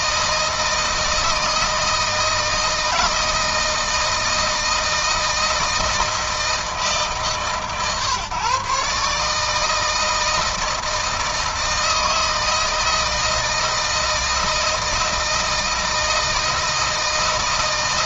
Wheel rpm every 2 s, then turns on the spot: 160, 160, 160, 160, 140, 160, 160, 160, 160.
none